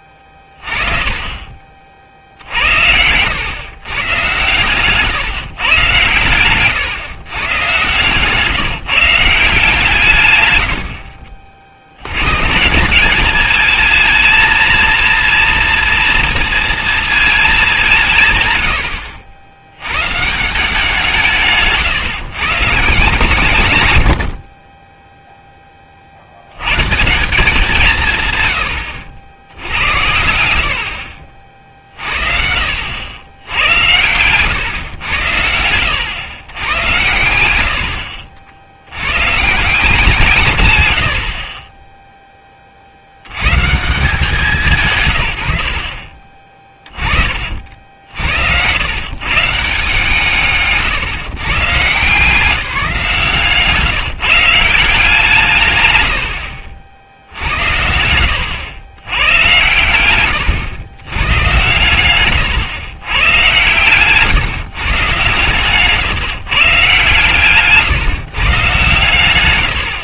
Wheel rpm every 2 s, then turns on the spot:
20, 80, 120, 120, 160, 90, 170, 230, 240, 110, 160, 140, 30, 100, 110, 70, 70, 120, 110, 70, 110, 40, 160, 30, 90, 150, 170, 170, 70, 110, 100, 120, 140, 140, 150.
4-6